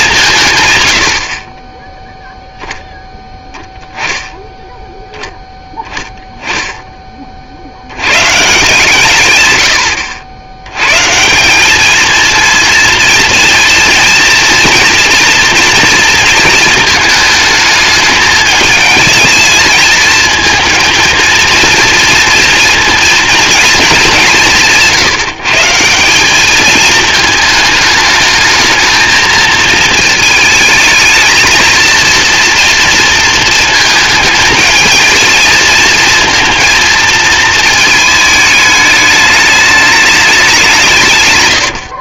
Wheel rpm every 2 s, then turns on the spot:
130, 0, 10, 10, 150, 100, 230, 230, 220, 220, 220, 230, 170, 210, 220, 220, 230, 220, 230, 210, 180.
none